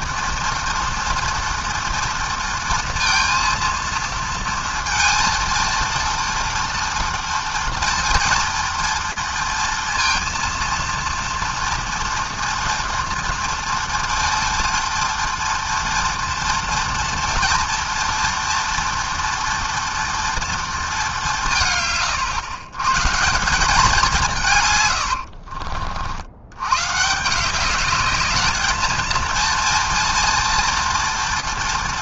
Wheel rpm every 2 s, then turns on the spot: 230, 230, 230, 230, 230, 230, 240, 230, 230, 230, 230, 110, 150, 100, 210, 230.
none